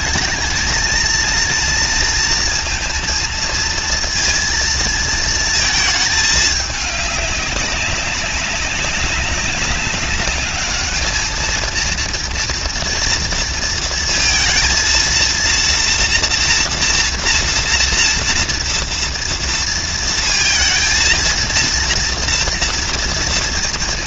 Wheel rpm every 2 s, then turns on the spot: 230, 230, 220, 210, 190, 220, 230, 230, 230, 230, 230, 230.
none